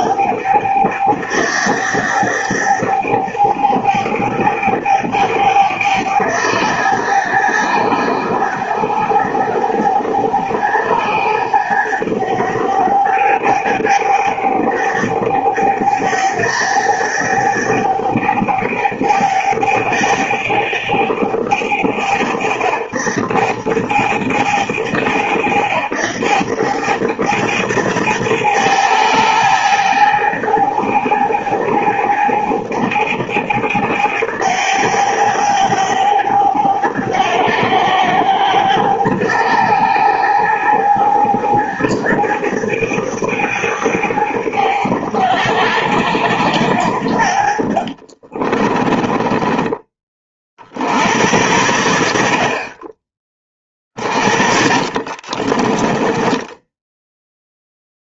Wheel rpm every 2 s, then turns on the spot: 100, 100, 100, 100, 100, 100, 100, 100, 100, 100, 100, 90, 100, 100, 110, 110, 110, 110, 100, 110, 110, 100, 100, 100, 30, 50, 40, 40, 10.
48-50 54-58